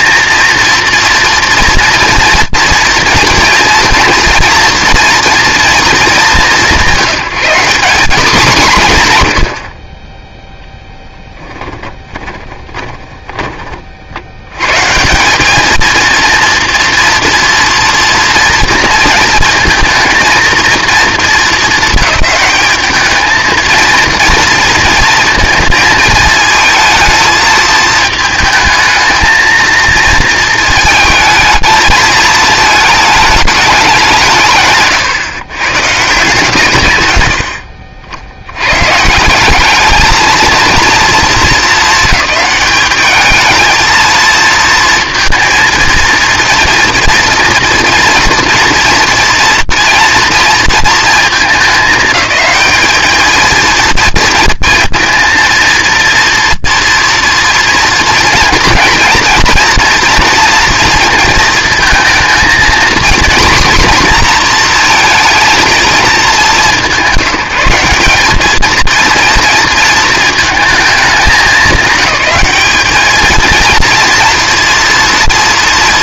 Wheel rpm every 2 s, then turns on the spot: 230, 230, 230, 170, 170, 0, 10, 110, 230, 230, 230, 210, 230, 220, 220, 230, 220, 150, 150, 110, 220, 200, 230, 230, 230, 230, 210, 230, 230, 230, 230, 230, 240, 180, 220, 230, 210, 230.
12-14 36-38